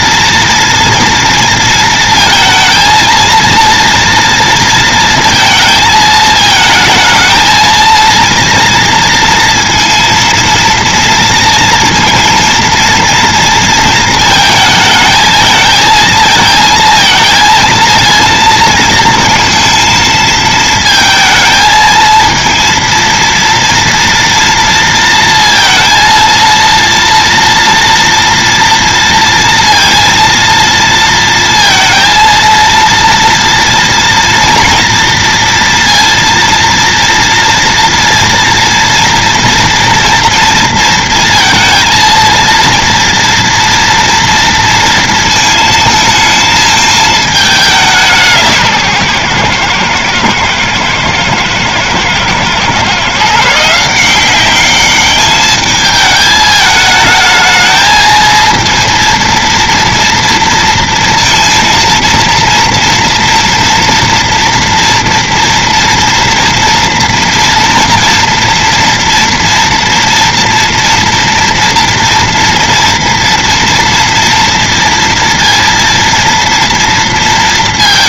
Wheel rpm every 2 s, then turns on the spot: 240, 230, 230, 220, 230, 230, 230, 220, 230, 230, 220, 230, 230, 230, 230, 230, 230, 230, 230, 230, 230, 230, 230, 220, 160, 110, 130, 200, 220, 230, 230, 230, 230, 230, 230, 230, 230, 230, 230.
none